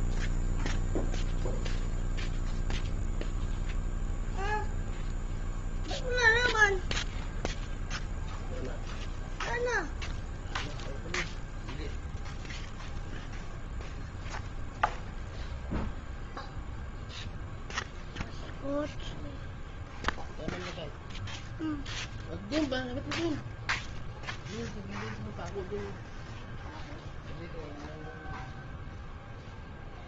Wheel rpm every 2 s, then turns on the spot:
0, 0, 0, 0, 0, 0, 0, 0, 0, 0, 0, 0, 0, 0, 0.
none